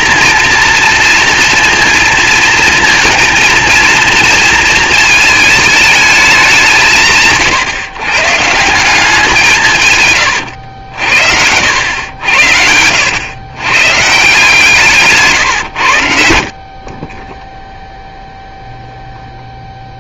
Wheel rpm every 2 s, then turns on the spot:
230, 230, 230, 180, 170, 90, 90, 160, 50, 0.
14-16